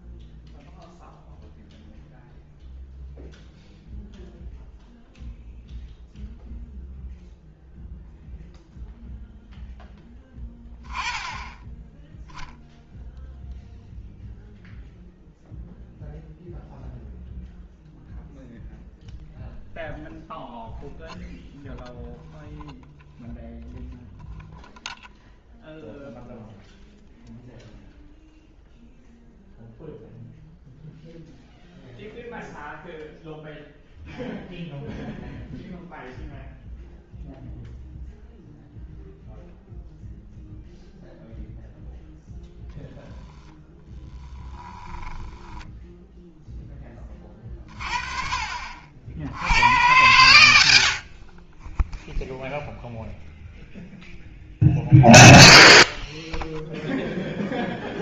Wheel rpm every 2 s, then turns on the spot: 0, 0, 0, 0, 0, 10, 0, 0, 0, 0, 0, 0, 0, 0, 0, 0, 0, 0, 0, 0, 0, 0, 20, 10, 60, 70, 0, 0, 0.
44-46